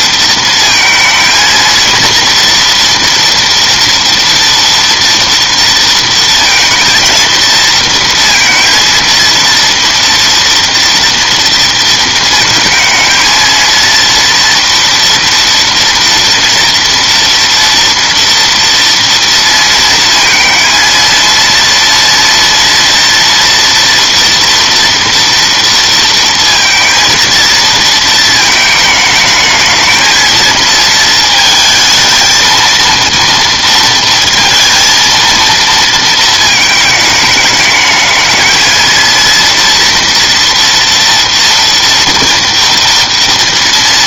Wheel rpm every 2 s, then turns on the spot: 230, 230, 240, 230, 230, 230, 230, 230, 230, 230, 230, 230, 230, 230, 220, 220, 230, 230, 210, 230, 230, 230.
none